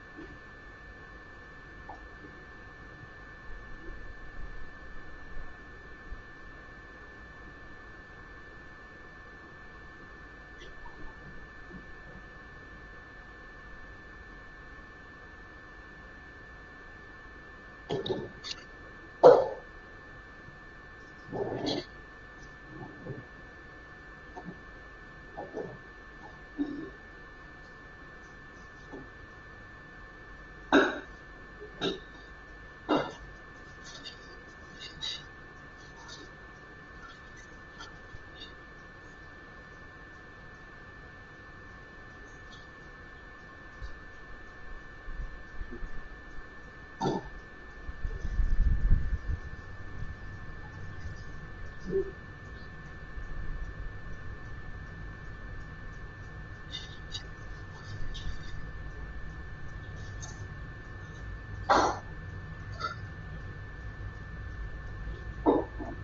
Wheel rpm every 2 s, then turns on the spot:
0, 0, 0, 0, 0, 0, 0, 0, 0, 0, 0, 0, 0, 0, 0, 0, 0, 0, 0, 0, 0, 0, 0, 0, 0, 0, 0, 0, 0, 0, 0, 0, 0.
none